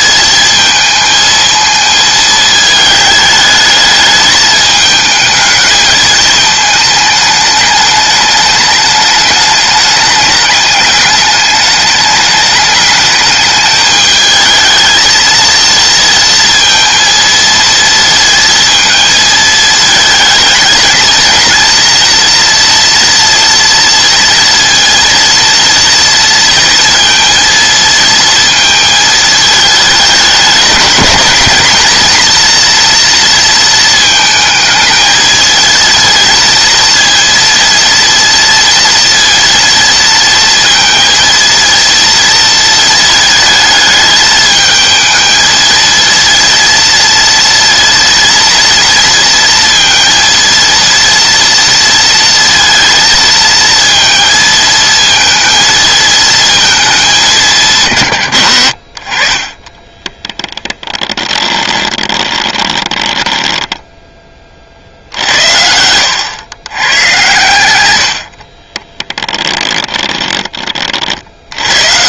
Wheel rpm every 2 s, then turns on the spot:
230, 220, 210, 220, 210, 210, 210, 220, 230, 230, 220, 230, 230, 230, 230, 200, 240, 220, 230, 230, 230, 230, 220, 230, 230, 240, 230, 230, 220, 70, 20, 20, 50, 110, 30, 30.
60-64 68-70